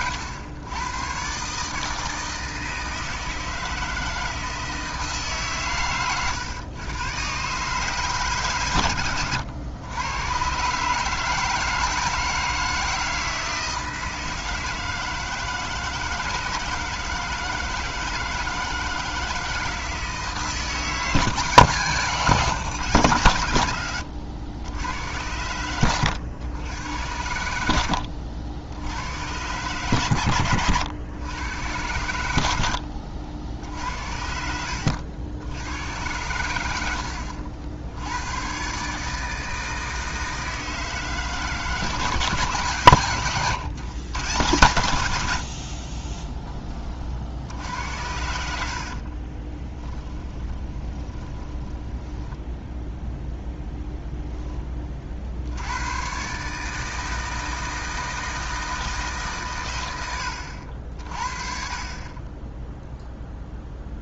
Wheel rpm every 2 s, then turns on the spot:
110, 160, 160, 120, 120, 140, 160, 160, 160, 160, 160, 130, 90, 100, 90, 100, 70, 80, 80, 140, 160, 140, 100, 30, 60, 20, 0, 30, 150, 160, 70, 0.
48-52